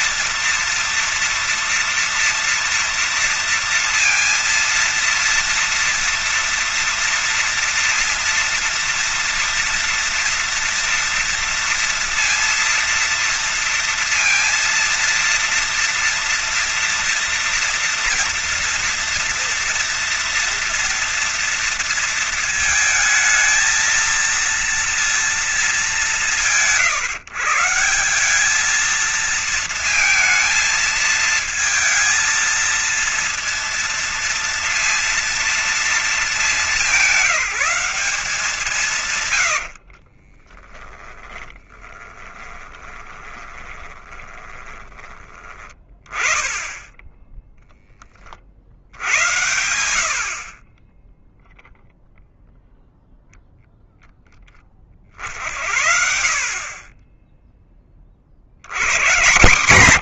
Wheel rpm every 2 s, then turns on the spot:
230, 230, 230, 230, 230, 230, 230, 230, 240, 230, 230, 230, 230, 150, 190, 220, 230, 230, 200, 170, 40, 20, 10, 10, 40, 40, 0, 20, 50, 60.
40-46